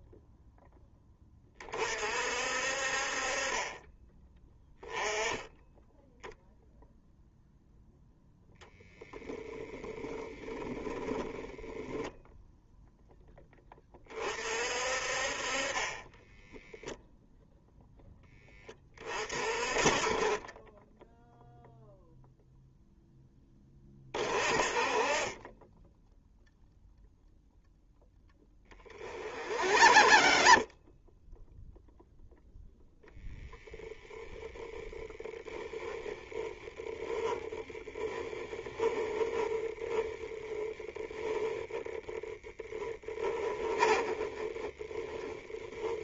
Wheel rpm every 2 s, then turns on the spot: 10, 50, 10, 0, 0, 10, 0, 40, 0, 30, 10, 0, 30, 0, 30, 30, 0, 10, 10, 10, 10, 10, 10.
10-12 28-32 34-40 42-44